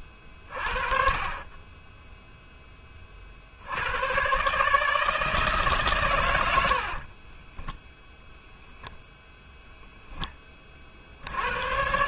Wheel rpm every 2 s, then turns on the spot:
40, 10, 150, 80, 0, 30.
none